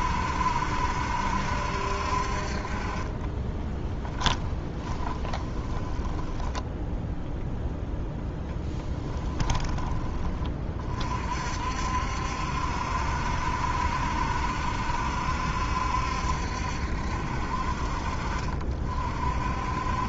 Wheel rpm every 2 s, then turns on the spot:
70, 40, 10, 10, 10, 30, 70, 70, 70, 50.
4-10